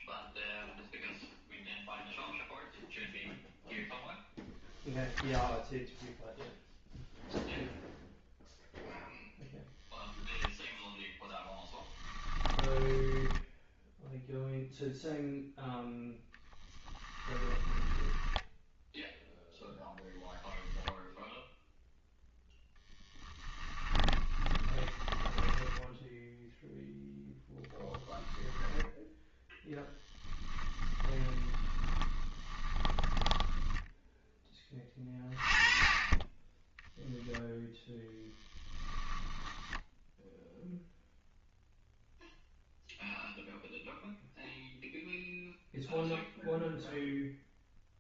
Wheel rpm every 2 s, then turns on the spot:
0, 0, 0, 0, 0, 0, 10, 0, 20, 0, 0, 10, 10, 0, 10, 10, 20, 20, 0, 10, 0, 0, 0, 0.
12-14 16-18 22-26 30-34 38-40